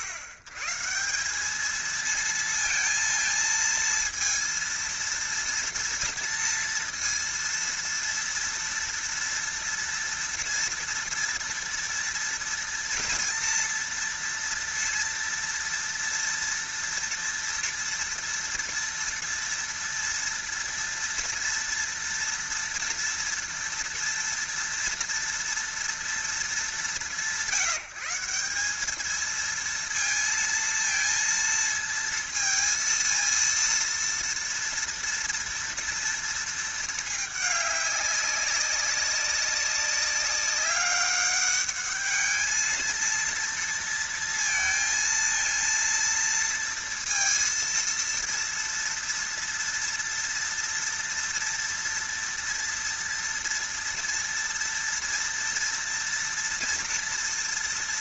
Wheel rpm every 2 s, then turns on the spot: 100, 230, 230, 230, 240, 230, 230, 230, 230, 230, 230, 230, 230, 190, 190, 230, 230, 230, 220, 200, 200, 220, 230, 230, 230, 230, 230, 230, 230.
none